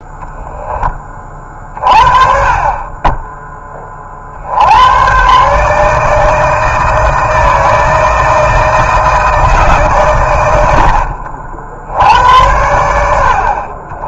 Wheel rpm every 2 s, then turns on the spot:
20, 20, 110, 160, 160, 80, 80.
10-12